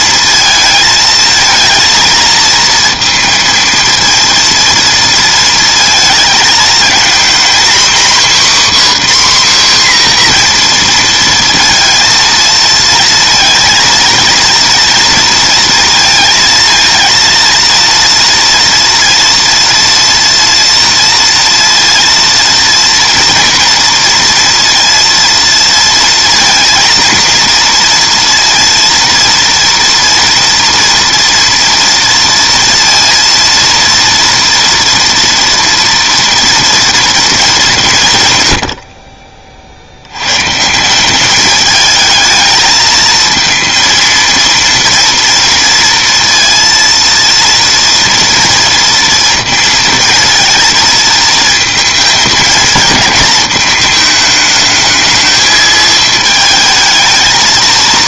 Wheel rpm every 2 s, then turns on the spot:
220, 230, 230, 220, 270, 240, 230, 230, 230, 230, 230, 230, 230, 230, 230, 230, 230, 230, 230, 90, 150, 220, 230, 230, 230, 230, 220, 210, 220.
none